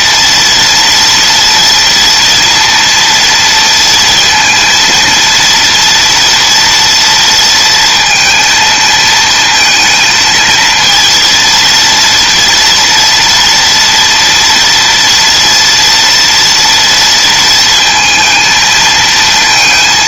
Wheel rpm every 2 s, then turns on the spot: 230, 230, 230, 230, 230, 230, 240, 240, 230, 220.
none